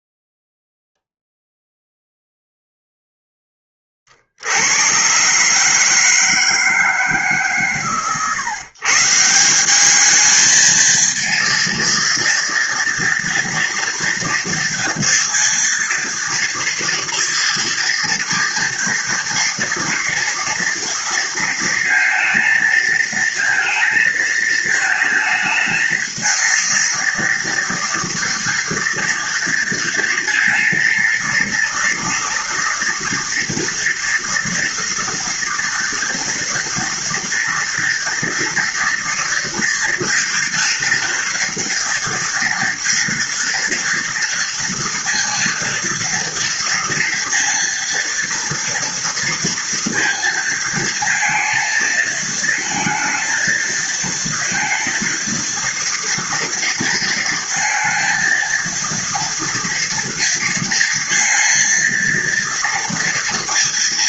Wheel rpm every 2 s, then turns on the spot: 0, 0, 130, 140, 160, 230, 240, 230, 230, 230, 230, 220, 220, 230, 230, 230, 230, 230, 230, 230, 230, 230, 230, 230, 230, 230, 220, 230, 230, 230, 230, 230.
none